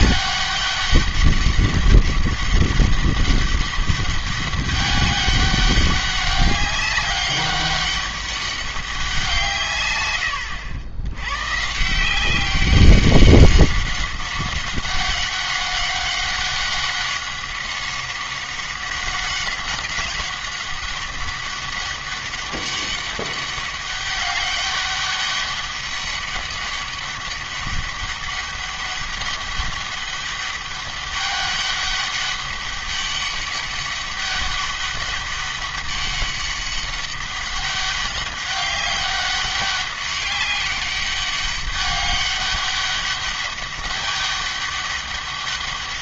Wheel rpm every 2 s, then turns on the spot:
200, 200, 200, 200, 200, 90, 190, 190, 190, 190, 190, 200, 200, 200, 200, 200, 200, 200, 200, 200, 200, 200, 200.
none